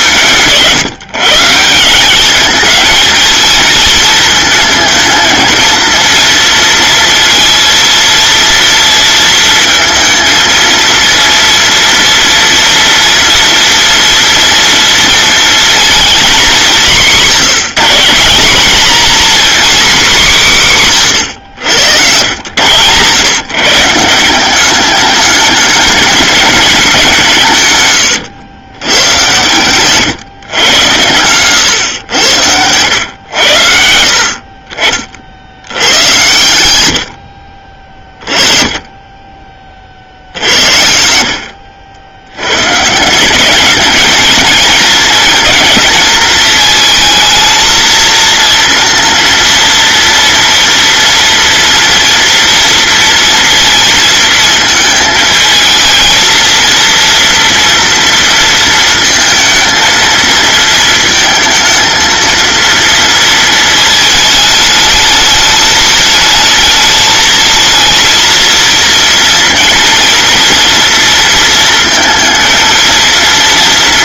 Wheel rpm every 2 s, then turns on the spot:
160, 220, 230, 230, 230, 230, 230, 230, 210, 220, 180, 110, 190, 190, 100, 110, 90, 50, 90, 20, 70, 120, 220, 220, 230, 240, 230, 220, 230, 230, 230, 230, 210, 220, 230, 230, 230.
none